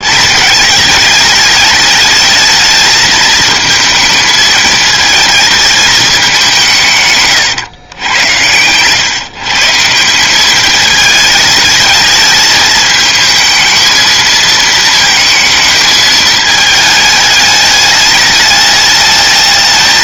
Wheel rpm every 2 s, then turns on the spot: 210, 220, 220, 150, 100, 210, 220, 220, 210, 210.
none